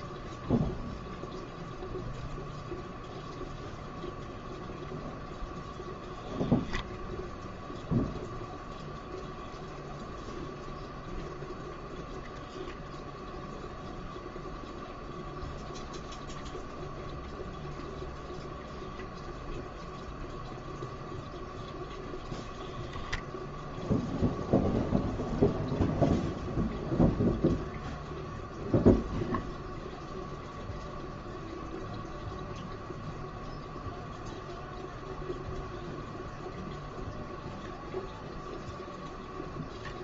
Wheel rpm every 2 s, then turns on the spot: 0, 0, 0, 0, 0, 0, 10, 0, 0, 0, 0, 0, 0, 0, 0, 0, 0, 0, 0, 0.
none